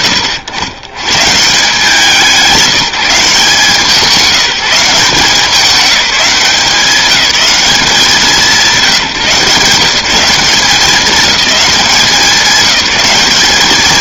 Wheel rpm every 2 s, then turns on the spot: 90, 180, 190, 200, 150, 200, 190.
none